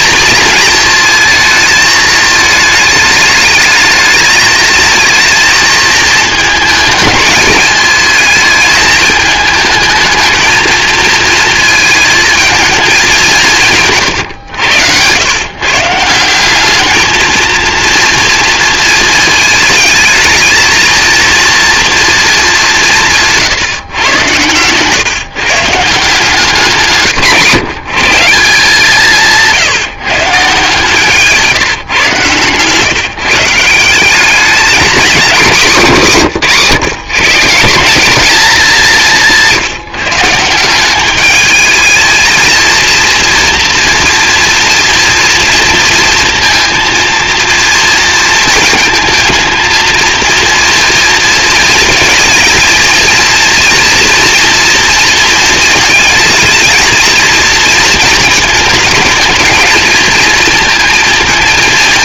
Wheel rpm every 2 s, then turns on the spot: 230, 220, 220, 210, 220, 230, 210, 110, 220, 220, 230, 170, 130, 150, 170, 140, 140, 210, 140, 190, 200, 230, 230, 230, 220, 230, 230, 230, 230, 220, 230.
none